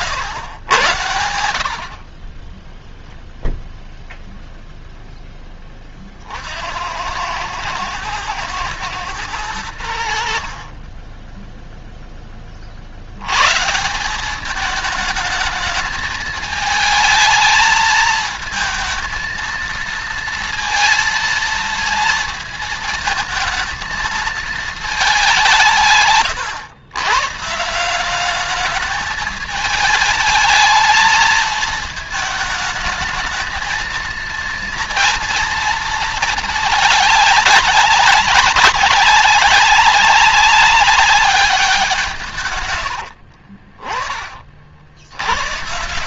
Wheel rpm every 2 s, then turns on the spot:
100, 10, 0, 60, 110, 50, 30, 200, 220, 220, 230, 220, 220, 150, 210, 220, 220, 230, 210, 190, 190, 140, 50.
none